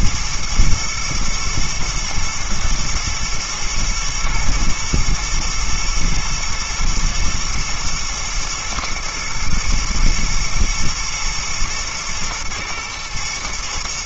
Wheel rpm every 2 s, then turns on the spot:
110, 120, 110, 120, 120, 120, 120.
none